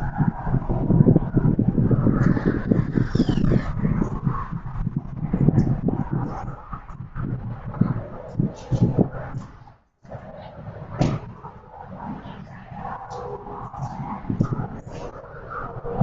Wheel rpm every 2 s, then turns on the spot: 0, 0, 0, 0, 0, 0, 0, 0.
none